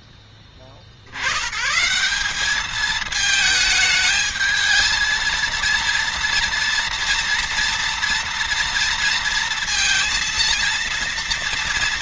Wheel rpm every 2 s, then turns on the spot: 60, 220, 220, 230, 230, 230.
none